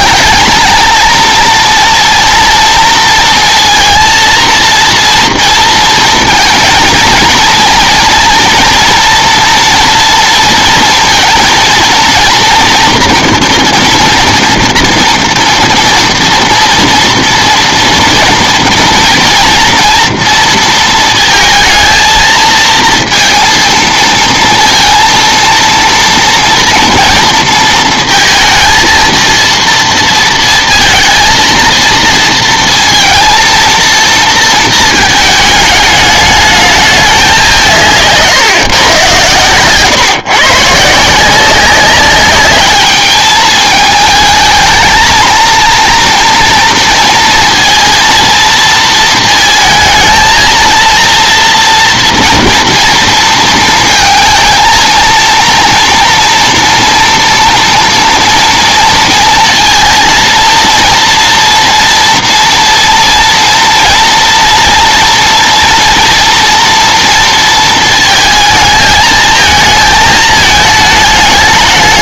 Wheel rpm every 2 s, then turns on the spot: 230, 230, 230, 230, 230, 230, 230, 230, 230, 240, 230, 220, 230, 230, 230, 230, 230, 230, 210, 140, 150, 200, 220, 230, 230, 230, 230, 220, 230, 230, 230, 230, 230, 230, 220, 220.
none